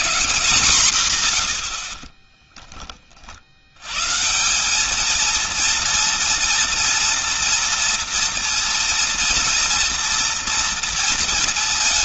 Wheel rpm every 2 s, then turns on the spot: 150, 20, 170, 230, 230, 230.
none